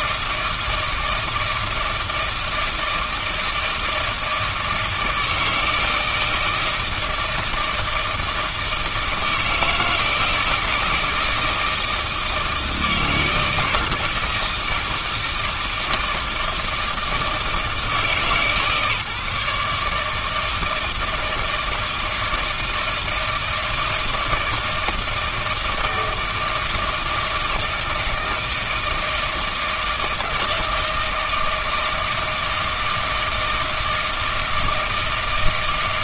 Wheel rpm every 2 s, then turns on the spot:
160, 160, 160, 160, 160, 160, 160, 160, 160, 150, 160, 160, 160, 160, 160, 160, 160, 160.
none